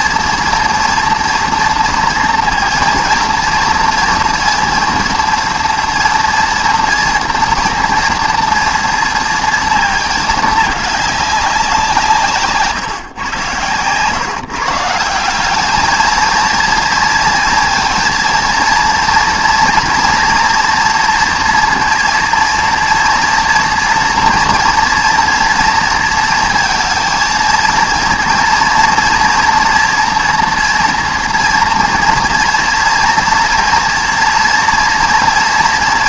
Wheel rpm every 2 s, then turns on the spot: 230, 230, 230, 230, 230, 210, 150, 150, 230, 230, 230, 230, 240, 230, 230, 230, 230, 230.
none